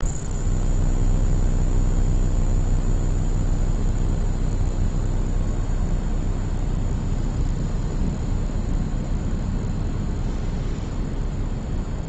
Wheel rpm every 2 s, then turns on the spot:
0, 0, 0, 0, 0, 0.
none